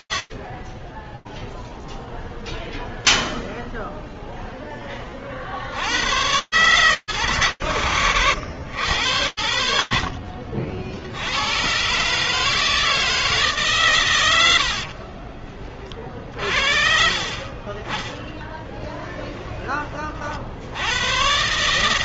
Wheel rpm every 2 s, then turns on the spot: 0, 10, 120, 100, 70, 140, 110, 40, 20, 40, 150.
8-10 16-18